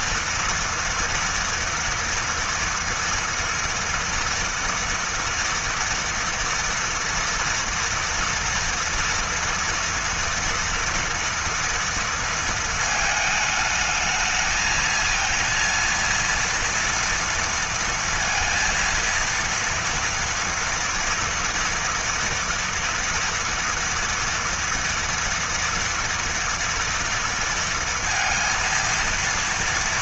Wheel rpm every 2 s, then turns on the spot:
230, 230, 230, 230, 230, 230, 220, 220, 230, 230, 230, 230, 230, 230, 230.
none